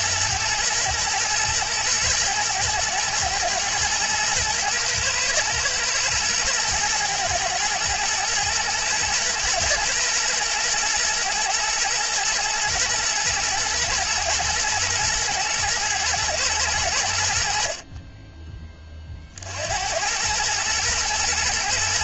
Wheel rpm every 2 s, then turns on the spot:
120, 110, 110, 110, 110, 120, 110, 120, 100, 30, 120.
none